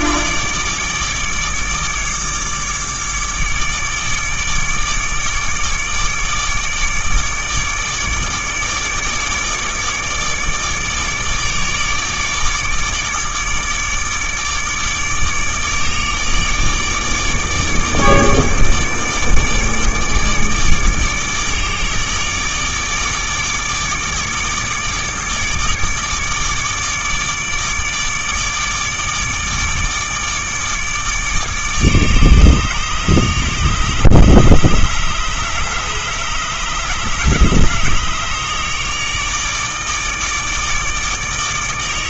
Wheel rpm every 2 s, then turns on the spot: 150, 150, 150, 150, 150, 150, 150, 150, 150, 150, 150, 160, 150, 150, 150, 150, 150, 150, 150, 150, 150.
none